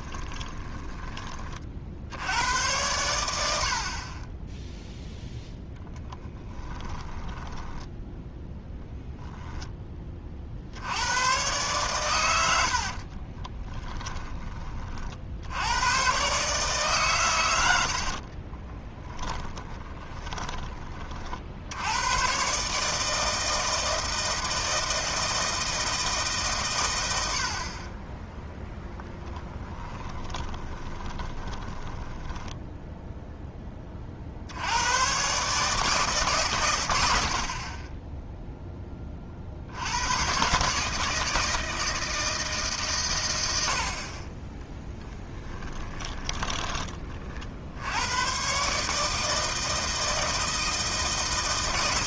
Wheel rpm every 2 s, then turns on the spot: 20, 90, 0, 10, 0, 70, 70, 40, 140, 20, 30, 150, 160, 110, 0, 20, 10, 90, 120, 10, 150, 140, 10, 20, 140, 160.
0-2 6-8 12-14 18-20 30-34 44-46